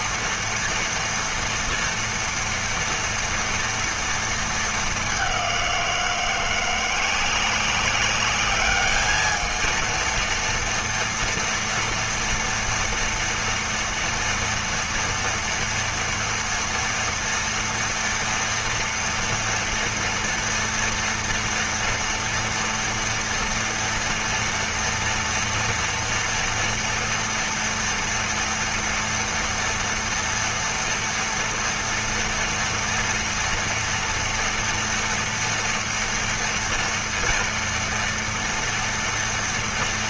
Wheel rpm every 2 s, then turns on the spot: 230, 230, 210, 180, 220, 230, 230, 230, 230, 230, 230, 230, 230, 230, 230, 230, 230, 230, 230, 230.
none